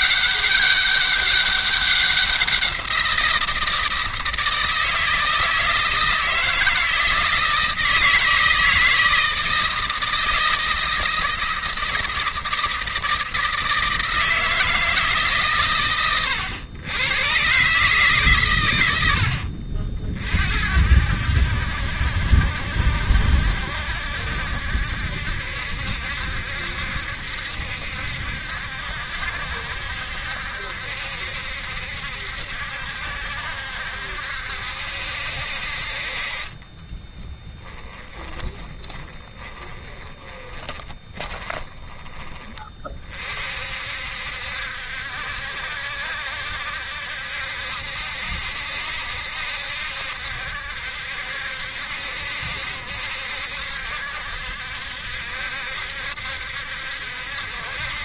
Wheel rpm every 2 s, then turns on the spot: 200, 180, 160, 170, 160, 160, 160, 160, 110, 120, 60, 70, 70, 70, 70, 70, 70, 70, 30, 20, 20, 30, 70, 70, 70, 70, 70, 70, 70.
36-42